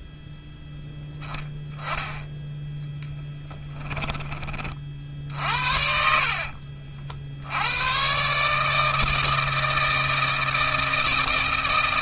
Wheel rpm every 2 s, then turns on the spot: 0, 0, 40, 60, 160, 160.
none